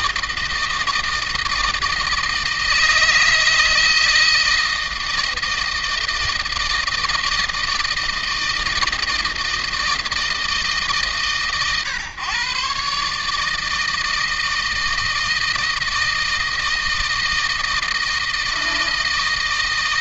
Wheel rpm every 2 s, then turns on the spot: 160, 160, 160, 160, 160, 150, 140, 160, 160, 160.
none